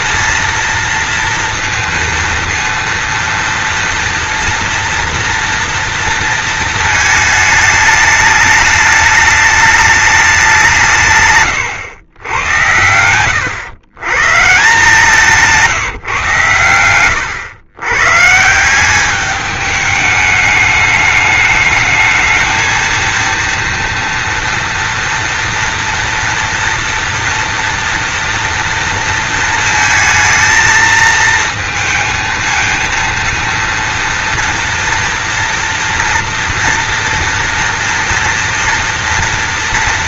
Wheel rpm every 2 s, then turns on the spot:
230, 230, 230, 220, 210, 140, 90, 160, 100, 190, 210, 230, 230, 230, 230, 230, 230, 230, 230, 230.
none